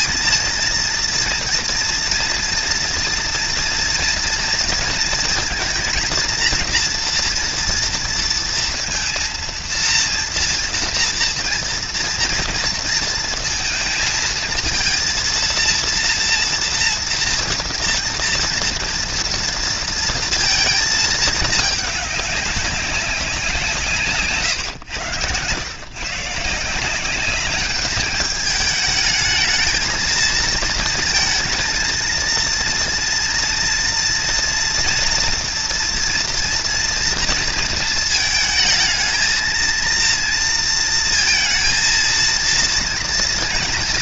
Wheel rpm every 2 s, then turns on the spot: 230, 230, 230, 230, 230, 230, 230, 230, 230, 230, 220, 190, 110, 190, 220, 230, 230, 240, 230, 220, 230, 230.
none